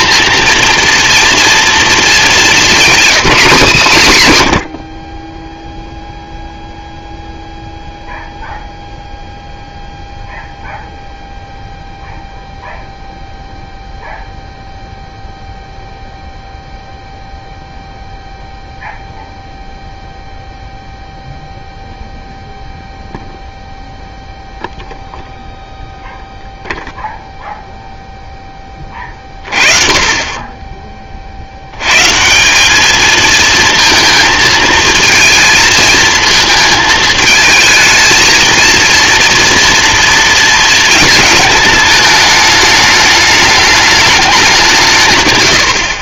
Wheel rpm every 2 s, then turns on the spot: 230, 220, 110, 0, 0, 0, 0, 0, 0, 0, 0, 0, 0, 0, 20, 20, 210, 220, 220, 230, 220, 210, 160.
none